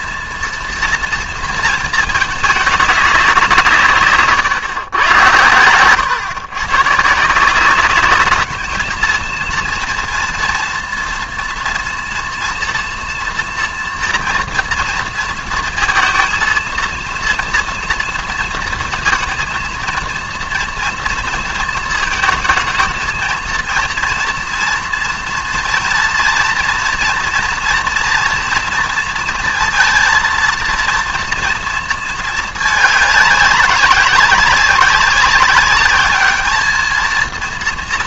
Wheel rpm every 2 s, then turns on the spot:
230, 210, 130, 130, 210, 240, 230, 230, 230, 230, 230, 220, 230, 230, 230, 230, 220, 200, 220.
none